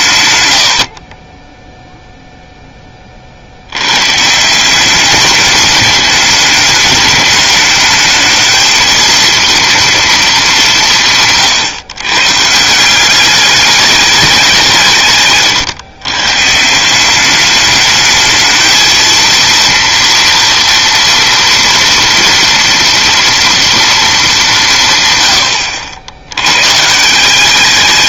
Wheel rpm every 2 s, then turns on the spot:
90, 10, 190, 210, 230, 190, 160, 170, 160, 220, 230, 230, 180, 120.
none